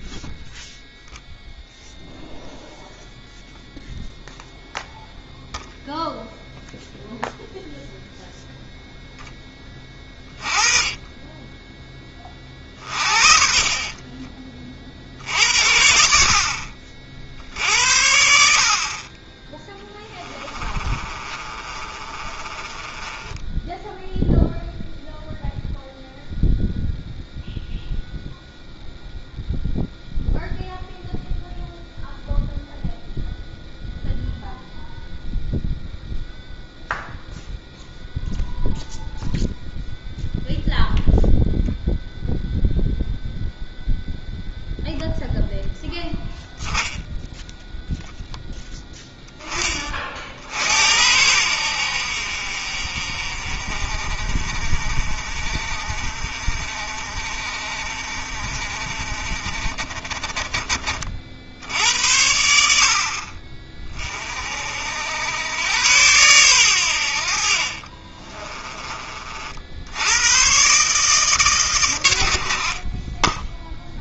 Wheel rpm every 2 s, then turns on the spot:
0, 0, 0, 0, 0, 20, 40, 40, 50, 50, 20, 20, 0, 0, 0, 0, 0, 0, 0, 0, 0, 0, 0, 0, 10, 70, 50, 40, 40, 40, 30, 70, 50, 100, 20, 120, 50.
12-14 20-24 68-70